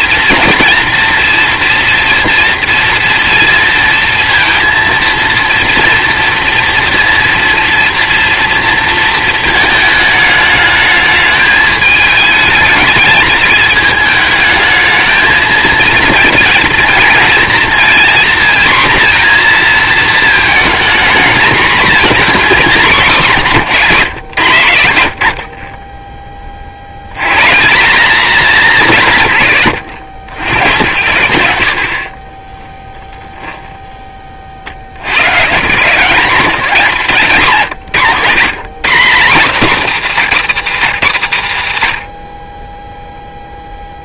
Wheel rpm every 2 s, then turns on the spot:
230, 230, 230, 230, 230, 220, 210, 220, 240, 240, 230, 210, 100, 80, 160, 100, 10, 60, 180, 130, 130, 10.
none